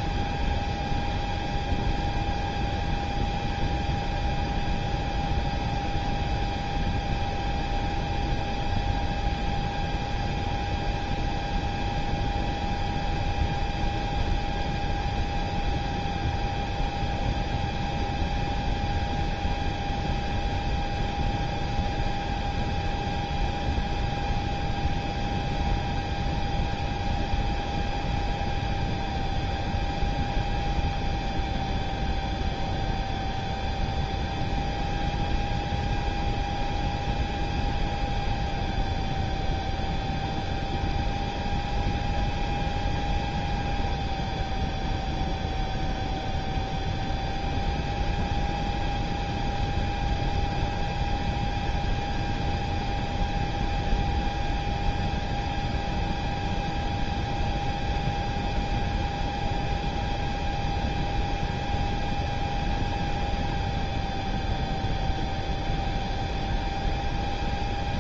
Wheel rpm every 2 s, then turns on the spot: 0, 0, 0, 0, 0, 0, 0, 0, 0, 0, 0, 0, 0, 0, 0, 0, 0, 0, 0, 0, 0, 0, 0, 0, 0, 0, 0, 0, 0, 0, 0, 0, 0, 0.
none